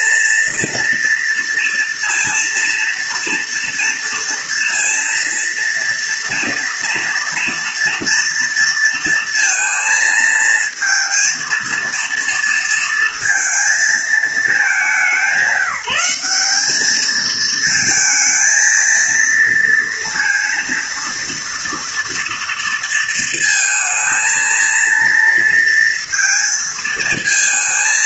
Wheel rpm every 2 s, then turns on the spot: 230, 230, 230, 230, 230, 230, 230, 180, 210, 230, 230, 230, 230, 230.
none